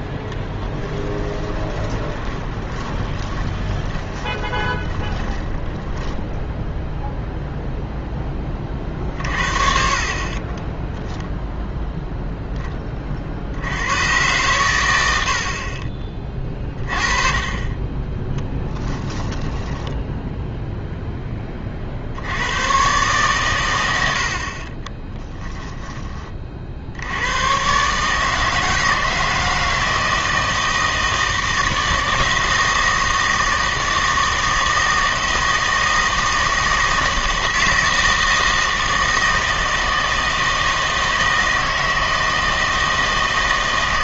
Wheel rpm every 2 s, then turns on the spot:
10, 20, 20, 0, 30, 10, 20, 100, 30, 10, 0, 120, 30, 70, 160, 160, 160, 160, 160, 160, 160, 160.
0-6 10-12 18-20